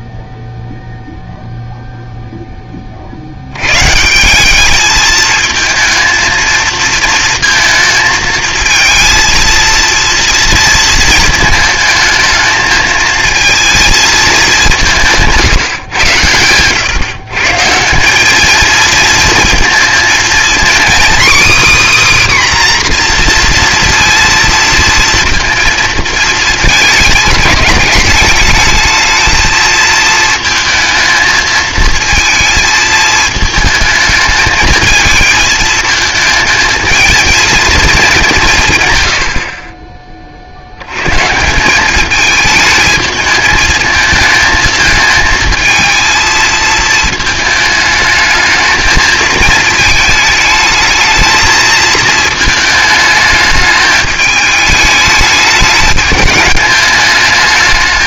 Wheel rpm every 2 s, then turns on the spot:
0, 0, 160, 220, 220, 230, 220, 220, 110, 190, 230, 280, 230, 220, 210, 220, 220, 220, 230, 190, 40, 210, 220, 220, 220, 220, 220, 210, 210.
none